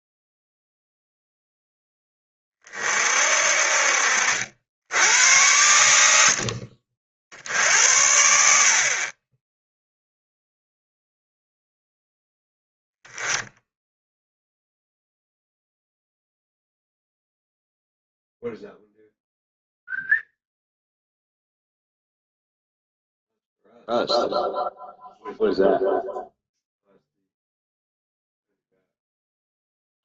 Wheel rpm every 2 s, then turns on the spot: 0, 40, 80, 50, 40, 0, 10, 0, 0, 0, 0, 0, 0, 0, 0.
none